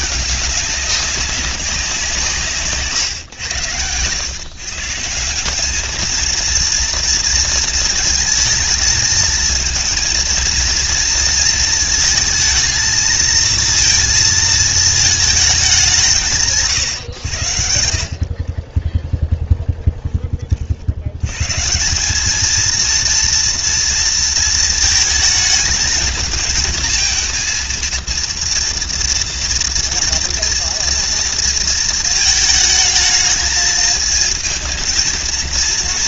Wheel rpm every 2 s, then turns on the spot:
200, 150, 130, 230, 220, 230, 220, 220, 150, 40, 40, 220, 220, 220, 230, 230, 220, 220.
18-20